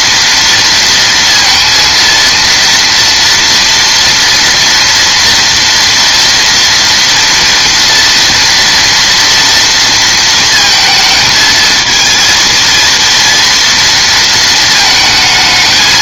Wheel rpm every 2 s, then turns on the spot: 230, 230, 230, 230, 240, 230, 230, 220.
none